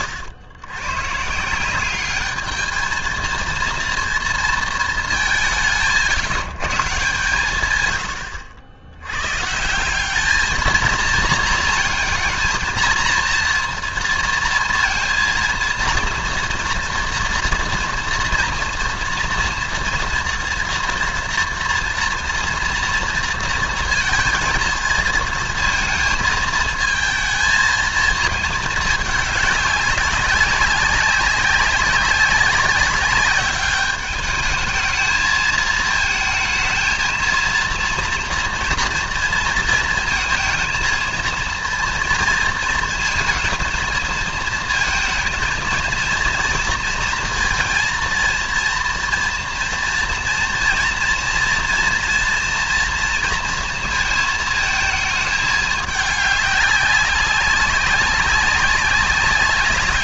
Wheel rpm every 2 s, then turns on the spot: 120, 220, 220, 150, 90, 220, 230, 230, 230, 230, 230, 230, 230, 220, 210, 200, 200, 220, 220, 230, 230, 230, 220, 230, 230, 240, 230, 220, 200, 190.
none